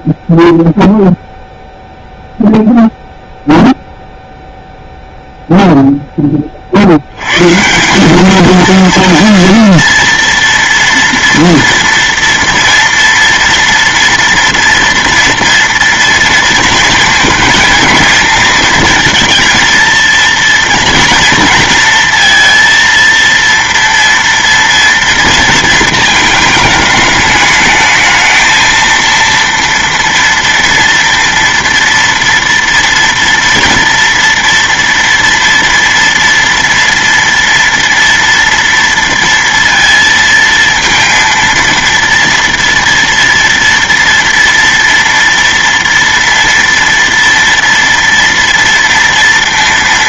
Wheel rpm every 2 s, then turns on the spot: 0, 0, 0, 60, 230, 230, 230, 230, 230, 220, 230, 230, 230, 220, 230, 230, 230, 230, 230, 230, 230, 230, 230, 230, 230.
none